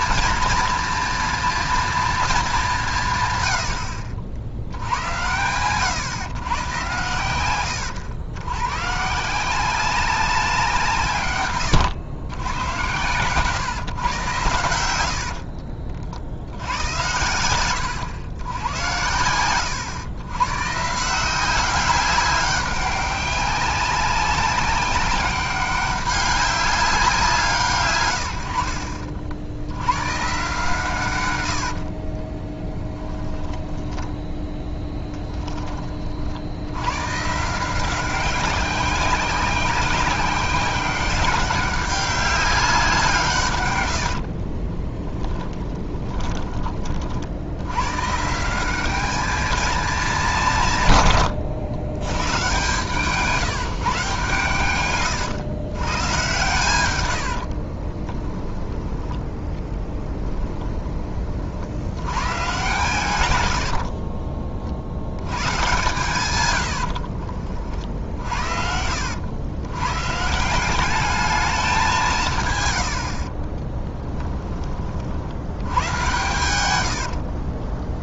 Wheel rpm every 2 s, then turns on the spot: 230, 190, 80, 110, 120, 160, 100, 100, 80, 90, 140, 190, 200, 190, 60, 140, 10, 10, 90, 190, 190, 180, 30, 30, 200, 150, 140, 120, 100, 10, 10, 130, 60, 110, 70, 190, 90, 30, 90.
16-18 32-34 44-46 52-58 66-68